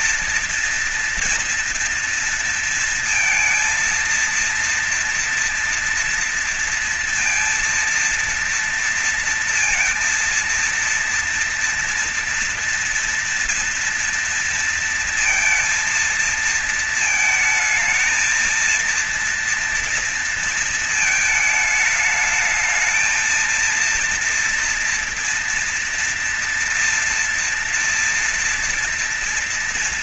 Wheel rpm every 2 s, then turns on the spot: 230, 230, 230, 230, 230, 230, 230, 230, 230, 220, 230, 220, 230, 230, 230.
none